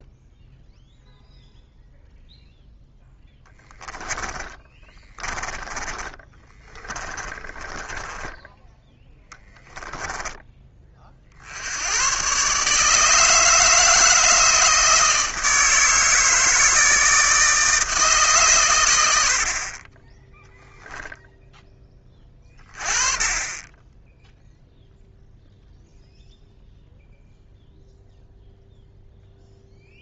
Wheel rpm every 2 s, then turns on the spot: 0, 0, 10, 30, 10, 30, 140, 160, 160, 120, 10, 30, 0, 0, 0.
4-8